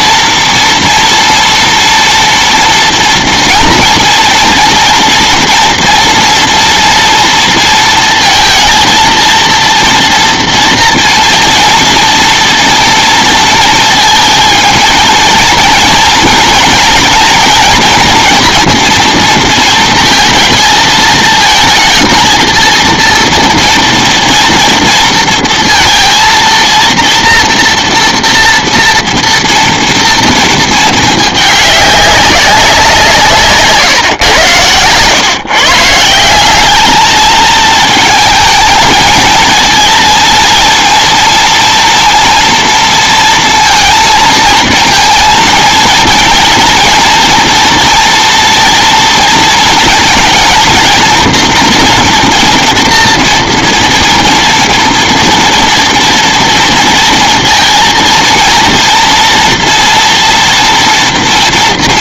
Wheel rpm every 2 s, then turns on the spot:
230, 230, 230, 230, 230, 230, 230, 230, 230, 230, 220, 230, 230, 230, 230, 220, 180, 110, 200, 220, 230, 230, 230, 230, 240, 230, 230, 230, 230, 230, 240.
none